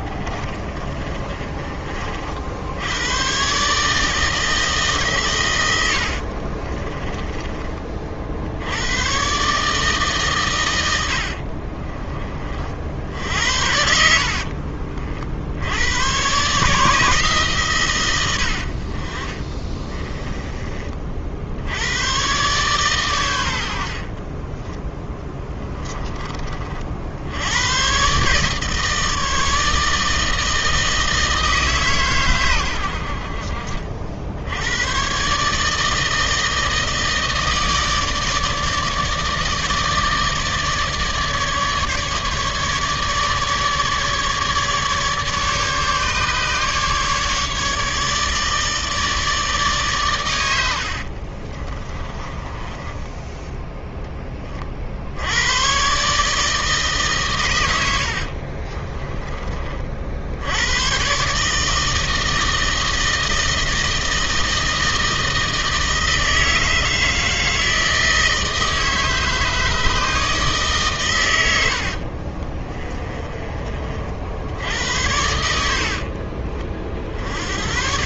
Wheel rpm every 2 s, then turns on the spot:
30, 100, 150, 30, 100, 100, 60, 40, 150, 50, 40, 130, 20, 60, 150, 160, 80, 110, 160, 150, 150, 150, 150, 150, 150, 80, 20, 50, 150, 30, 120, 160, 160, 160, 160, 140, 20, 80, 50.
0-2 6-8 24-26 50-54 58-60 72-74